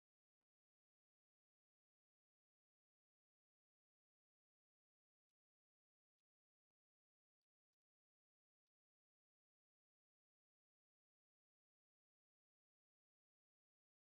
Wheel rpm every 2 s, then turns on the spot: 0, 0, 0, 0, 0, 0, 0.
none